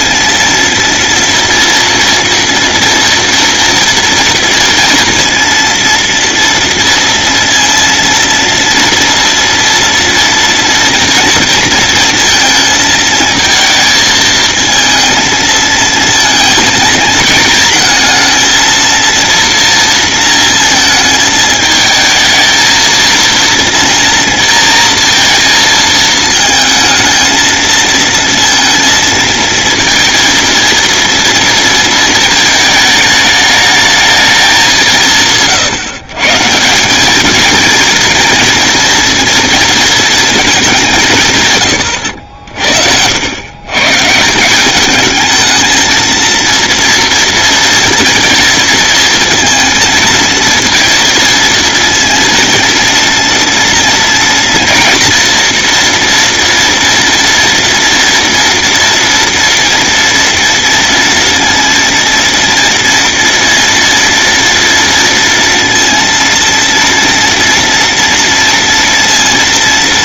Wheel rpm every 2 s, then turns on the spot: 230, 230, 230, 230, 230, 230, 230, 220, 220, 230, 220, 230, 230, 220, 230, 230, 220, 170, 200, 230, 180, 70, 220, 230, 230, 230, 230, 230, 230, 230, 230, 230, 230, 230, 230.
none